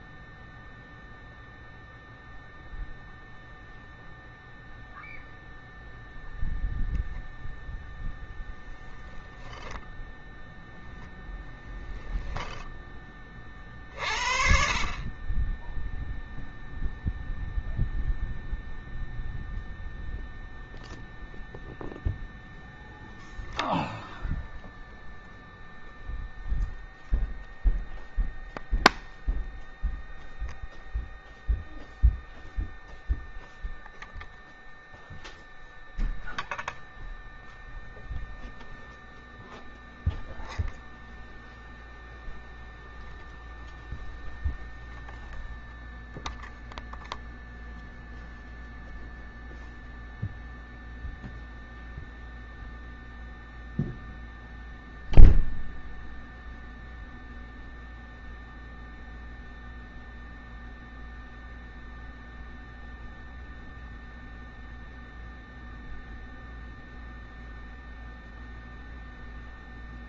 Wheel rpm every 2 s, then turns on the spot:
0, 0, 0, 0, 10, 0, 20, 40, 0, 0, 0, 0, 0, 0, 0, 0, 0, 0, 0, 0, 0, 0, 0, 0, 0, 0, 0, 0, 0, 0, 0, 0, 0, 0, 0.
none